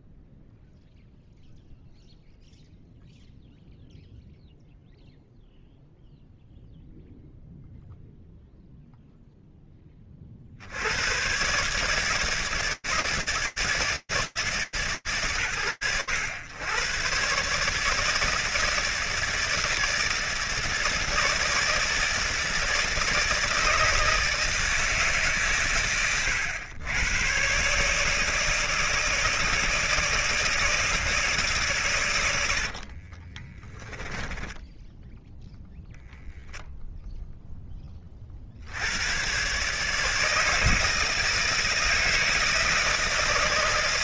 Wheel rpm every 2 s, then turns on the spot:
0, 0, 0, 0, 0, 90, 160, 160, 110, 160, 160, 160, 160, 110, 150, 160, 80, 10, 0, 100, 160, 160.
32-34